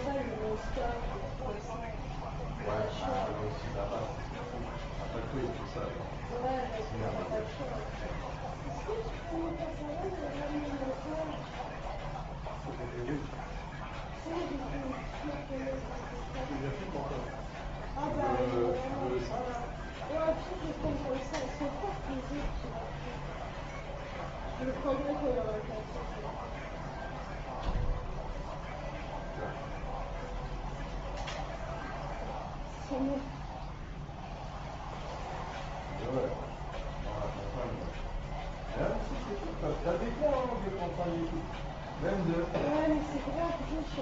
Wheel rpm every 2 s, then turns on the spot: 0, 0, 0, 0, 0, 0, 0, 0, 0, 0, 0, 0, 0, 0, 0, 0, 0, 0, 0, 0, 0, 0.
none